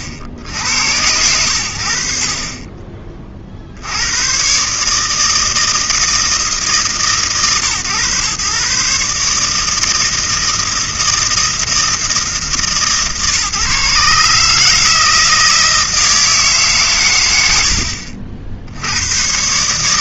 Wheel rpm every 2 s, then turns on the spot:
80, 40, 140, 160, 140, 160, 160, 160, 160, 40.
none